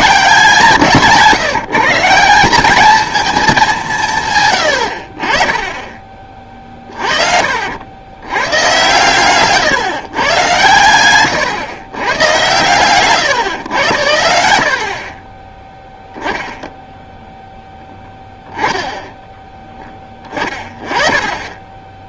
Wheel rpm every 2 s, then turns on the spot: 160, 190, 110, 30, 110, 110, 120, 80, 10, 10, 20.
4-6